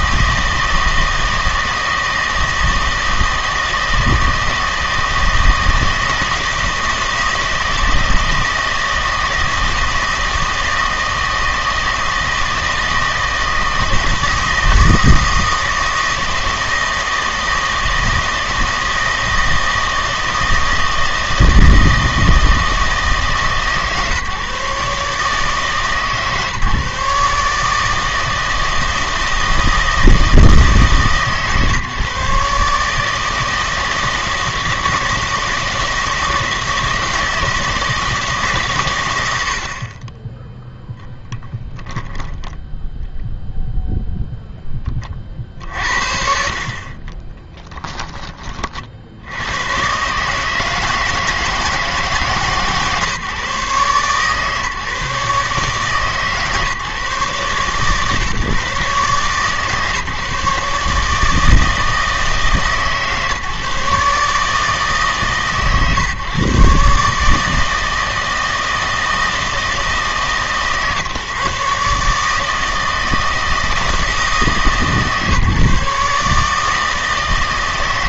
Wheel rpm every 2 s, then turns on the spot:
160, 160, 160, 160, 160, 160, 160, 160, 160, 160, 160, 160, 140, 150, 160, 150, 150, 160, 160, 140, 10, 10, 10, 50, 40, 160, 150, 140, 150, 130, 140, 150, 150, 130, 160, 150, 160, 150, 150.
42-44